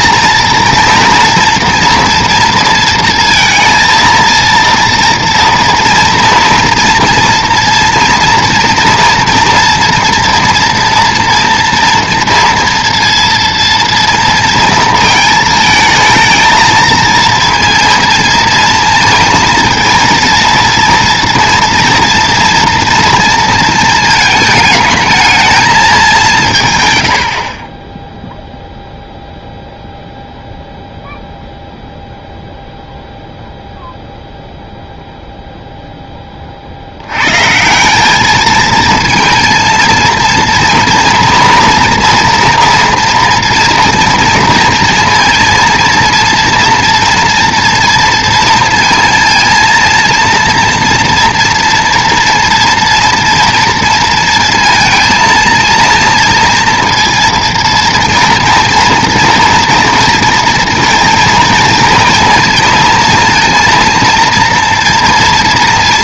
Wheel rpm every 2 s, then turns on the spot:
230, 230, 230, 230, 230, 240, 230, 230, 220, 230, 230, 230, 220, 170, 0, 0, 0, 0, 40, 220, 230, 230, 230, 230, 230, 230, 230, 230, 230, 240, 230, 230, 230.
none